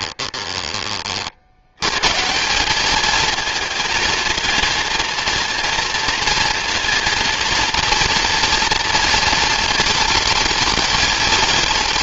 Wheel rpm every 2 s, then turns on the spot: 20, 200, 220, 230, 230, 230.
none